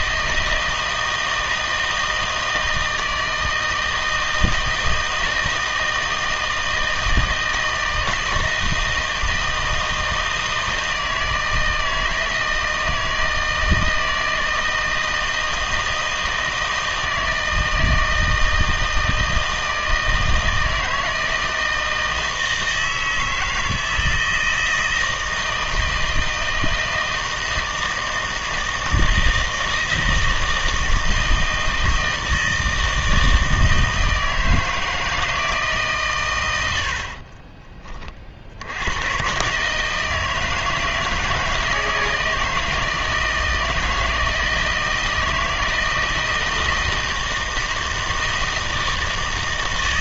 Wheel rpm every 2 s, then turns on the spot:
160, 160, 160, 160, 160, 160, 160, 160, 160, 160, 160, 160, 160, 160, 160, 160, 160, 160, 80, 70, 160, 160, 160, 160, 160.
none